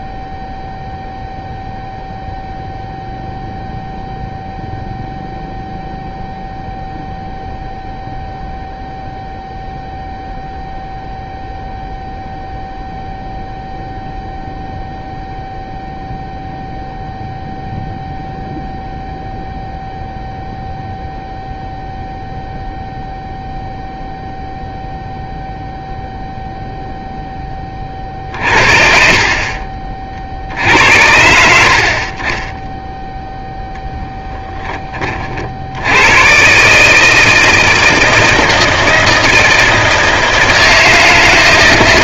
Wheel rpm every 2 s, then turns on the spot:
0, 0, 0, 0, 0, 0, 0, 0, 0, 0, 0, 0, 0, 0, 50, 70, 10, 10, 140, 160, 160.
none